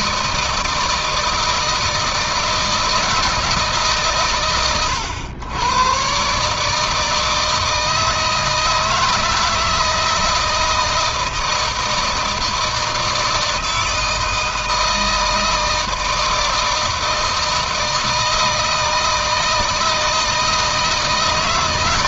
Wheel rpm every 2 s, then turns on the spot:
160, 160, 110, 150, 160, 160, 160, 160, 160, 160, 160.
none